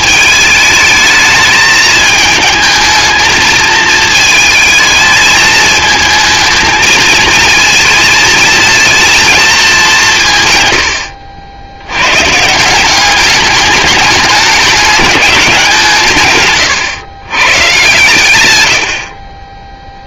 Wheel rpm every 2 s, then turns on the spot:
220, 220, 220, 220, 230, 110, 190, 200, 130, 70.
none